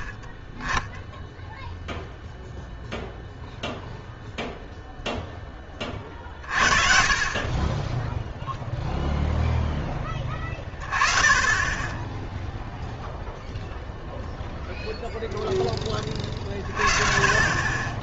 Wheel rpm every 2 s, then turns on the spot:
10, 0, 0, 50, 0, 20, 0, 0, 30.
none